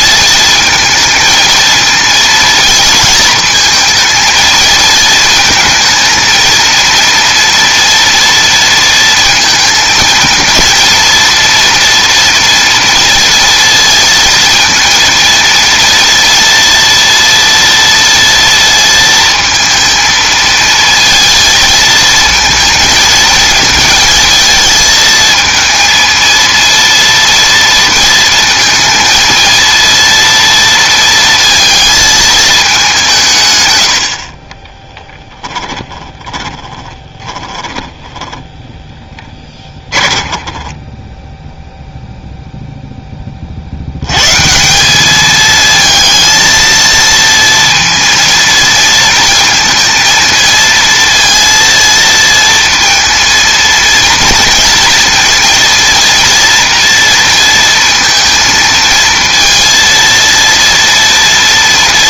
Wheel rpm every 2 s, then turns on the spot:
220, 230, 230, 230, 230, 230, 230, 230, 230, 230, 220, 230, 220, 230, 230, 230, 200, 20, 30, 10, 20, 0, 180, 230, 230, 230, 230, 230, 230, 230, 230.
34-42